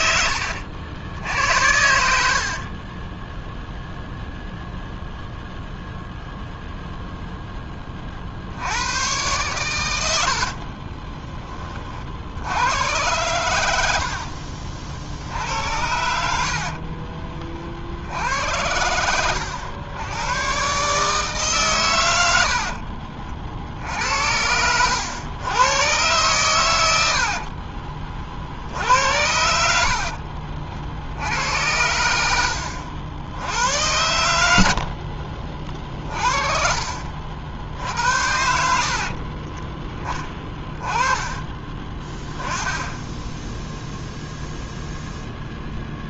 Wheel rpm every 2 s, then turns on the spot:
70, 30, 0, 0, 90, 30, 90, 60, 50, 80, 130, 50, 90, 110, 70, 60, 80, 60, 50, 60, 20, 10, 0.
2-4 10-12 16-18 22-24 34-36 38-40